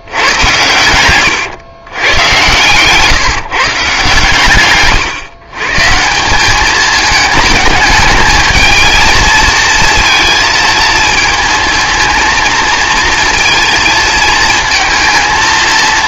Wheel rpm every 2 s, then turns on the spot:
110, 120, 140, 210, 220, 230, 230, 230.
2-4